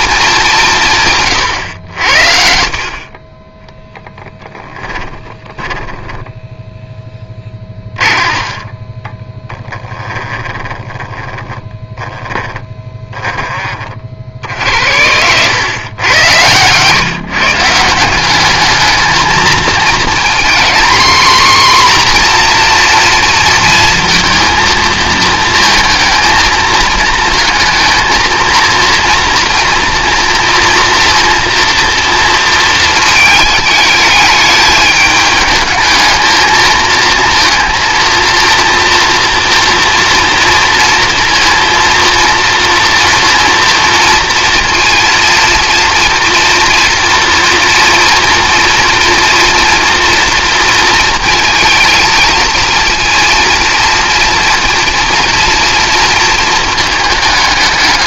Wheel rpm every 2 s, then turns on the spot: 180, 60, 10, 10, 30, 10, 10, 70, 130, 210, 240, 240, 230, 220, 230, 230, 220, 210, 220, 230, 230, 230, 230, 240, 230, 230, 230, 230, 220.
2-10 12-14